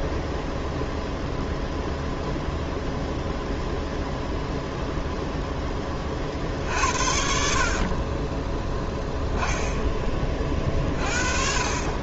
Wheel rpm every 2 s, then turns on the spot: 0, 0, 0, 60, 10, 40.
none